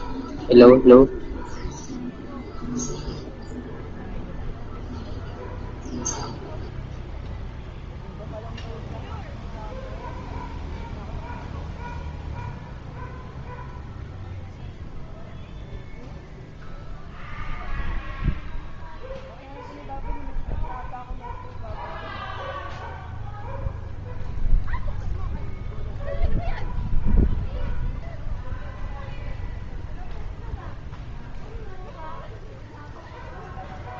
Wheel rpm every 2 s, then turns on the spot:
0, 0, 0, 0, 0, 0, 0, 0, 0, 0, 0, 0, 0, 0, 0, 0, 0.
none